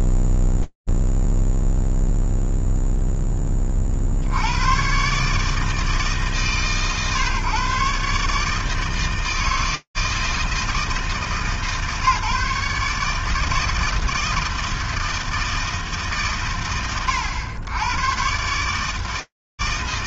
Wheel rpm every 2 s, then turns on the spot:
0, 0, 100, 130, 150, 160, 150, 160, 110, 130.
none